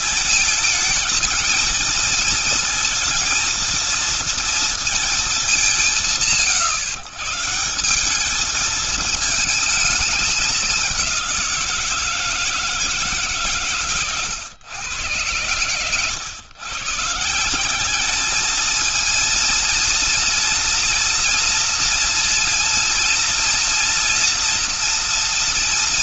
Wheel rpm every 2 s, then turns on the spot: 220, 230, 220, 150, 220, 190, 150, 110, 150, 220, 230, 230, 230.
none